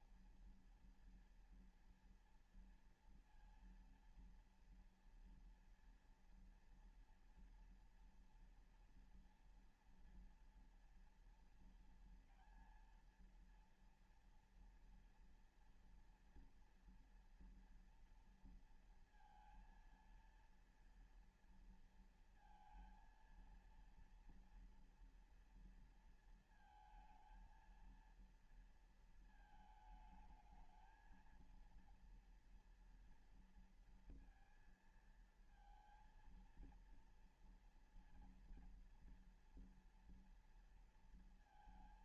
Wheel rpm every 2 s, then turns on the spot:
230, 230, 230, 240, 240, 230, 230, 230, 240, 230, 230, 230, 230, 220, 230, 220, 230, 230, 230, 230, 230.
none